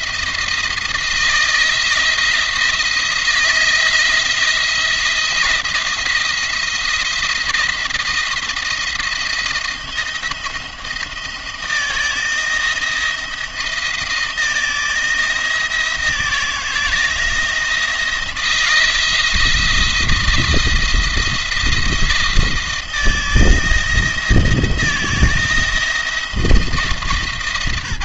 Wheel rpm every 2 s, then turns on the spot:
160, 170, 170, 170, 170, 160, 170, 160, 170, 170, 160, 170, 170, 160.
none